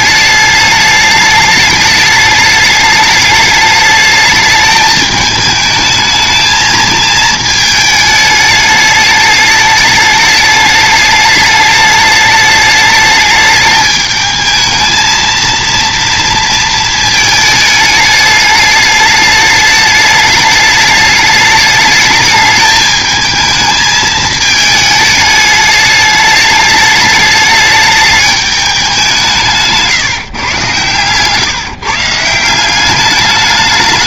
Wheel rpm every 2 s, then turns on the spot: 210, 210, 210, 220, 210, 210, 210, 220, 230, 210, 210, 210, 220, 210, 200, 130, 190.
none